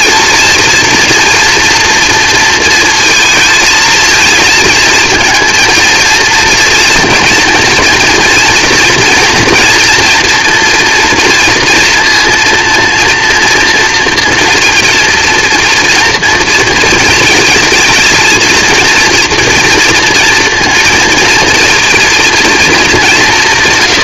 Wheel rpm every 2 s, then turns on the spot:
230, 230, 230, 230, 230, 240, 230, 230, 230, 230, 230, 220.
none